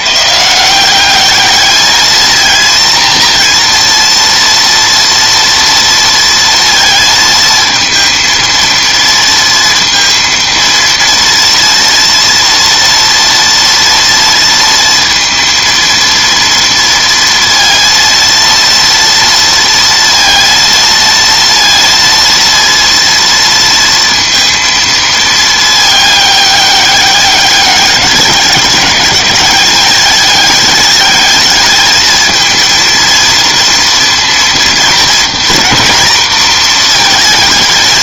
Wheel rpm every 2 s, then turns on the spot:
160, 230, 240, 230, 230, 230, 230, 230, 230, 230, 230, 230, 230, 200, 190, 210, 220, 230, 230.
none